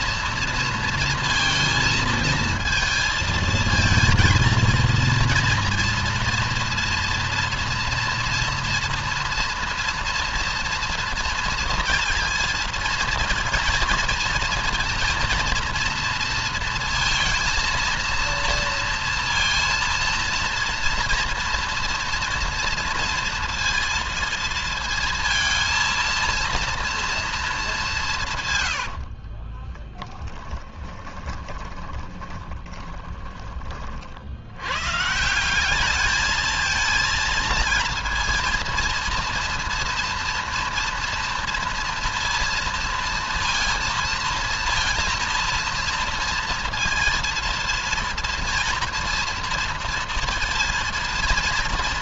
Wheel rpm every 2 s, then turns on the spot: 230, 220, 230, 230, 230, 230, 230, 230, 230, 230, 230, 230, 230, 240, 80, 20, 20, 140, 230, 230, 230, 230, 230, 230, 230, 230.
28-34